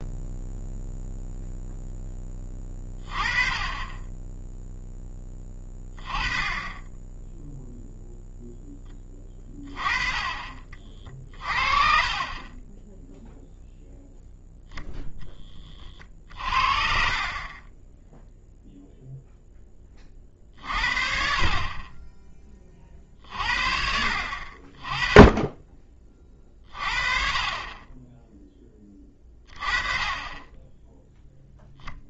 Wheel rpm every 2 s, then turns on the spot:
0, 20, 0, 10, 10, 40, 10, 0, 50, 0, 50, 30, 40, 30, 20, 10.
none